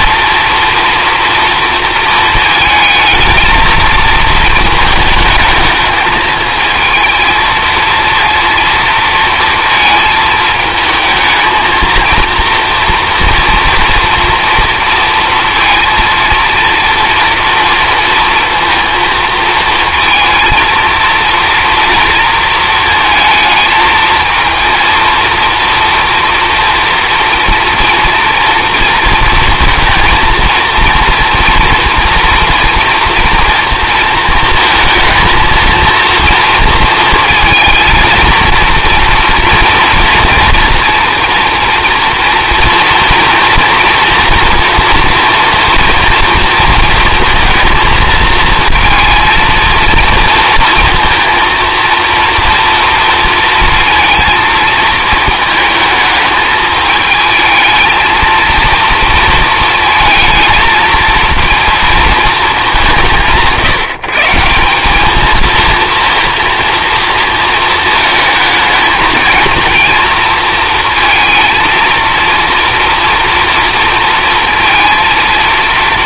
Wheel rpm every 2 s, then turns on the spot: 230, 220, 210, 220, 230, 220, 230, 230, 230, 230, 230, 230, 230, 230, 230, 230, 230, 230, 230, 230, 230, 240, 230, 230, 230, 230, 230, 220, 220, 230, 230, 170, 220, 230, 220, 230, 230, 230.
none